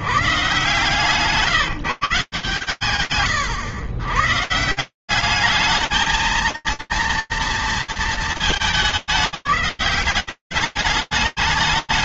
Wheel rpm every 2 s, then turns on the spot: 140, 120, 170, 230, 200, 190.
none